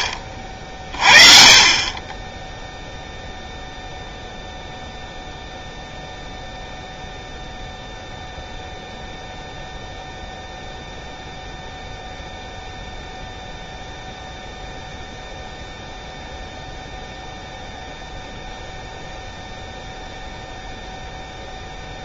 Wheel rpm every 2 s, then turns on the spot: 30, 0, 0, 0, 0, 0, 0, 0, 0, 0, 0.
none